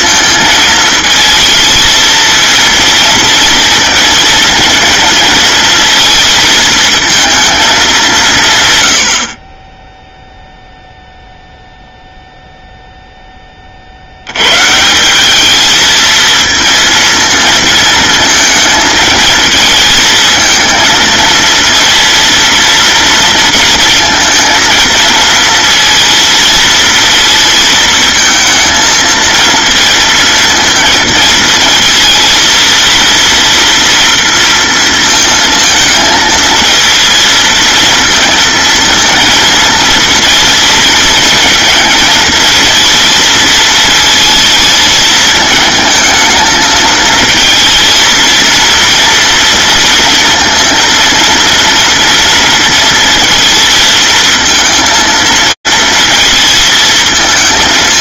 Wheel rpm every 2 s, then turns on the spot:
230, 230, 230, 230, 120, 0, 0, 120, 230, 220, 220, 230, 230, 230, 220, 230, 230, 230, 230, 230, 230, 230, 230, 220, 230, 230, 230, 230, 220.
none